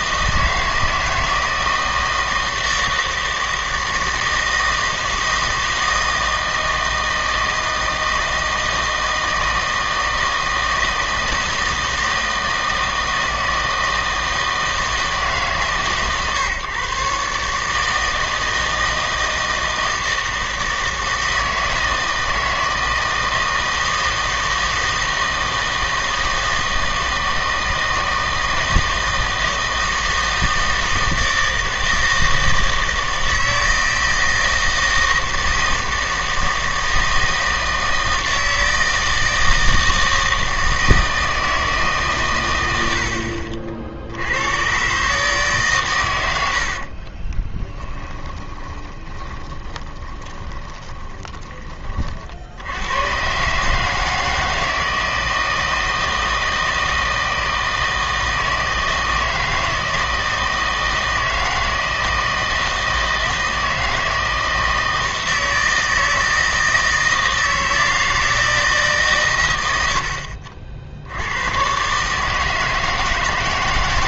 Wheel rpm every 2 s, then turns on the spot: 160, 160, 160, 160, 160, 160, 160, 160, 140, 160, 160, 160, 160, 160, 160, 160, 160, 160, 160, 160, 160, 90, 120, 60, 20, 20, 90, 160, 160, 160, 160, 160, 160, 160, 160, 60, 160.
46-52